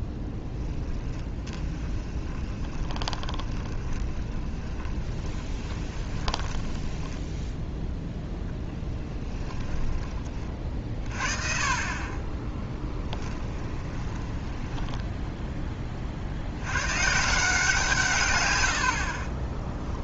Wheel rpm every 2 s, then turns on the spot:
20, 20, 20, 20, 10, 30, 10, 20, 110, 90.
0-10 12-16